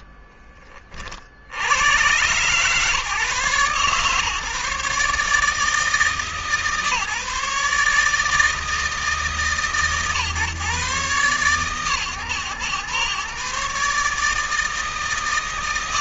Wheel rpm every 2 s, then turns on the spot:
40, 140, 150, 150, 160, 130, 110, 160.
none